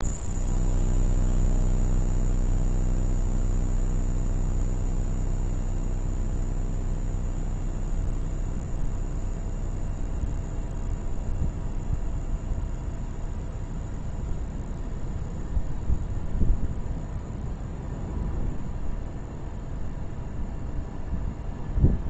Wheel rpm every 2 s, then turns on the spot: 0, 0, 0, 0, 0, 0, 0, 0, 0, 0, 0.
none